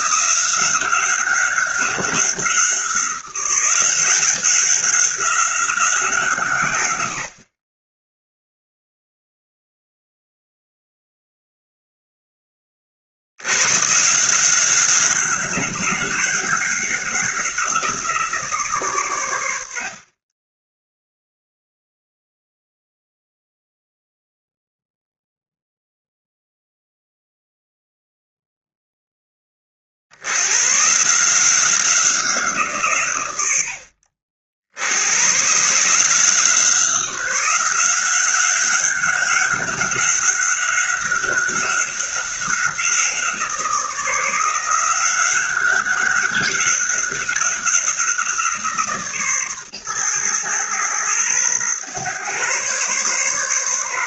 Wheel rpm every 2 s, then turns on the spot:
190, 180, 190, 110, 0, 0, 40, 190, 190, 150, 10, 0, 0, 0, 0, 130, 150, 80, 180, 200, 200, 180, 180, 200, 170, 120, 130.
none